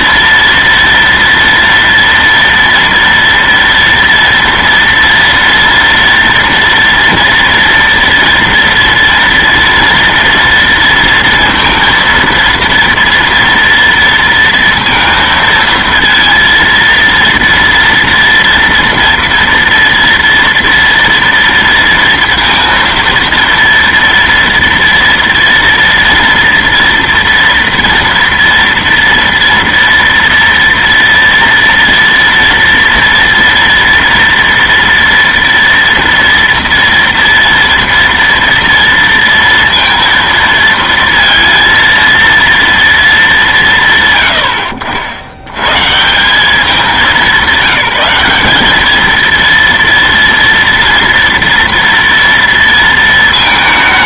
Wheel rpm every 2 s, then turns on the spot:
230, 230, 230, 230, 230, 230, 230, 230, 230, 230, 230, 230, 230, 240, 230, 230, 230, 230, 230, 230, 230, 230, 110, 180, 200, 230, 230.
none